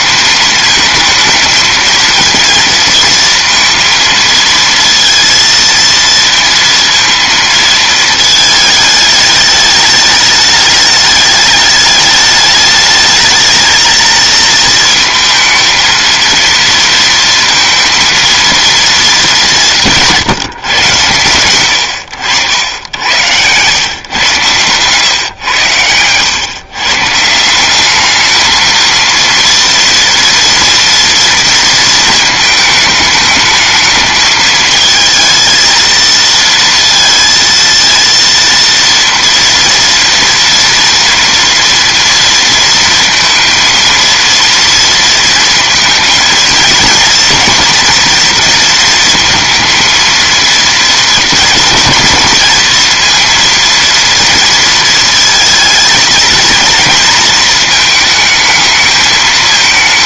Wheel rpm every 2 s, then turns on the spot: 220, 230, 230, 230, 210, 210, 210, 230, 230, 230, 120, 100, 130, 140, 230, 230, 220, 220, 230, 230, 230, 230, 230, 230, 230, 220, 230, 230, 230, 220.
none